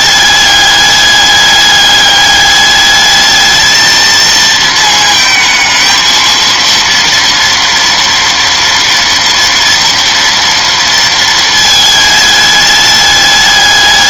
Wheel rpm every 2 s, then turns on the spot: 210, 210, 220, 230, 230, 230, 210.
none